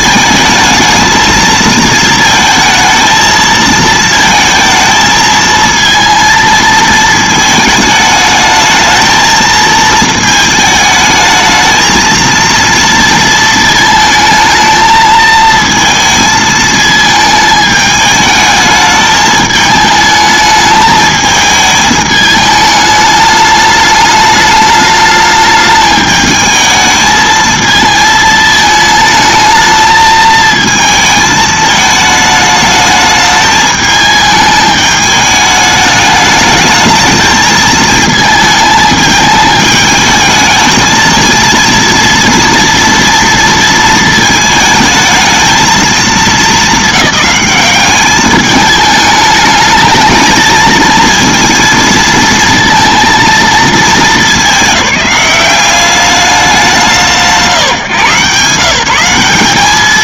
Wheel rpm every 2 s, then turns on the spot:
220, 220, 220, 230, 220, 220, 230, 220, 220, 210, 220, 210, 210, 220, 220, 220, 210, 210, 210, 220, 220, 230, 220, 200, 210, 230, 230, 200, 190, 160.
none